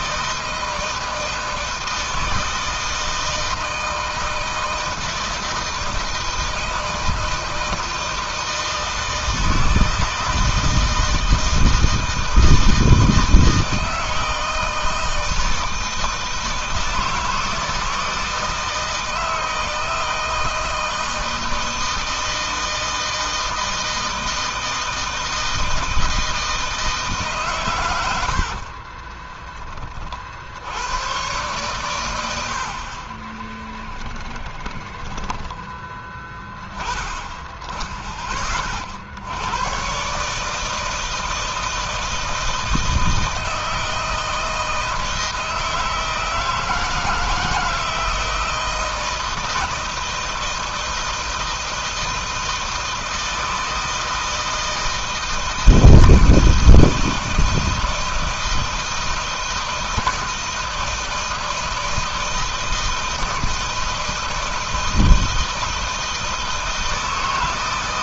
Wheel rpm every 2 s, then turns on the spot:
160, 160, 160, 160, 160, 160, 160, 160, 160, 160, 160, 160, 160, 160, 50, 70, 80, 20, 20, 30, 150, 160, 160, 160, 160, 160, 160, 160, 160, 160, 160, 160, 160, 160.
28-30 34-36